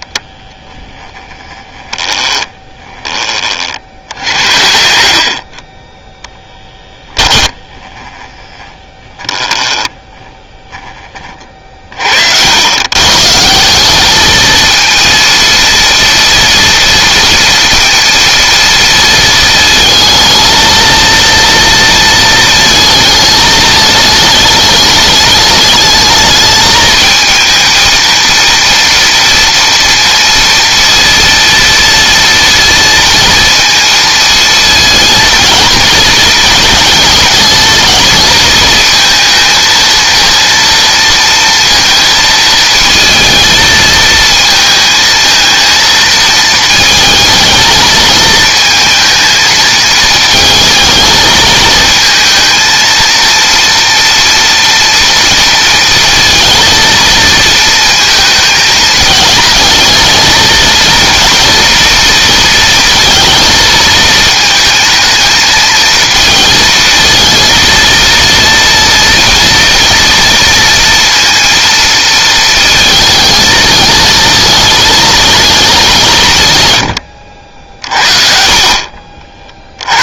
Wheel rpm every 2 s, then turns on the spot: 10, 20, 50, 10, 10, 20, 120, 230, 230, 230, 230, 220, 210, 220, 230, 230, 230, 230, 220, 220, 230, 220, 230, 220, 220, 220, 230, 230, 230, 220, 230, 220, 220, 220, 230, 230, 230, 220, 100, 50.
6-10